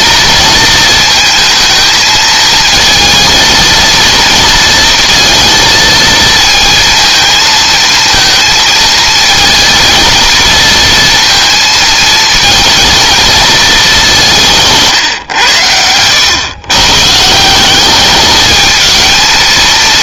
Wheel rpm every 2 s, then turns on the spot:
230, 220, 230, 230, 220, 230, 230, 140, 130, 220.
14-16